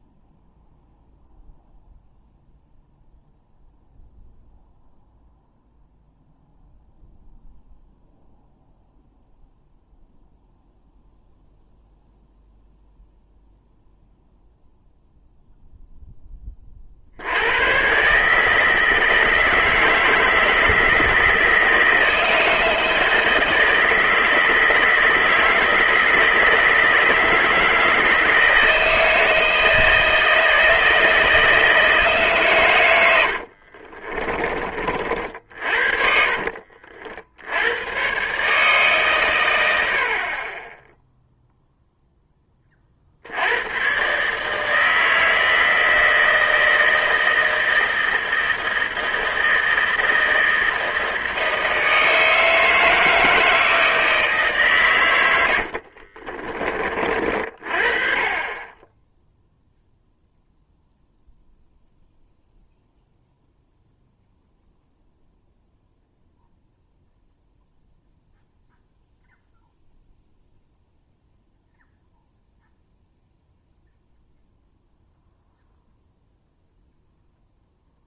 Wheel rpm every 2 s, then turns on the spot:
0, 0, 0, 0, 0, 0, 0, 0, 30, 150, 160, 160, 160, 160, 160, 160, 120, 30, 50, 140, 20, 30, 150, 160, 160, 160, 160, 140, 40, 20, 0, 0, 0, 0, 0, 0, 0, 0, 0.
none